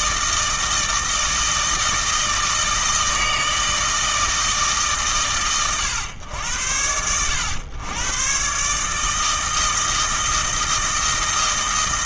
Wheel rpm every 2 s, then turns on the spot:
160, 160, 140, 90, 140, 160.
none